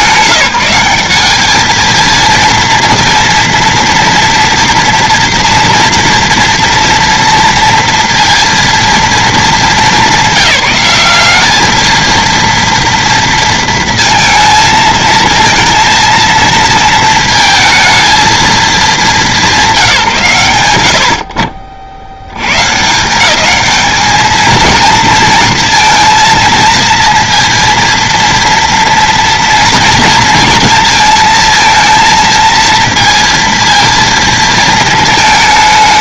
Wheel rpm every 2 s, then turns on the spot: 190, 230, 240, 240, 230, 210, 230, 230, 230, 200, 80, 150, 230, 230, 230, 230, 230, 220.
none